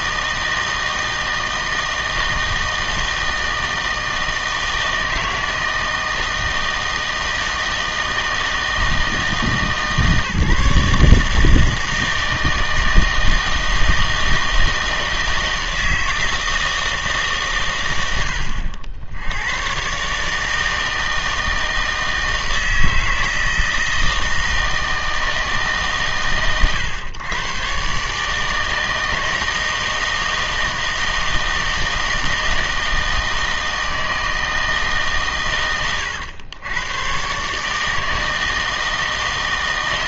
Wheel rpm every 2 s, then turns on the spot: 160, 160, 160, 160, 160, 150, 160, 160, 160, 80, 160, 160, 160, 120, 160, 160, 160, 160, 100, 160.
none